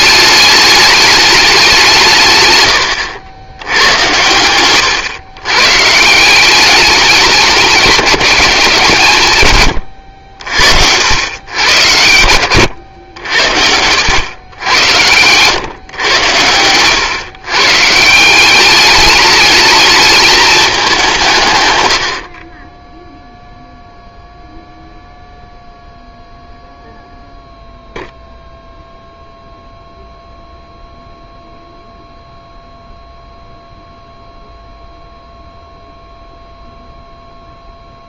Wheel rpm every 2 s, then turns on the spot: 210, 110, 110, 190, 190, 70, 110, 90, 100, 200, 210, 20, 0, 0, 0, 0, 0, 0, 0.
12-14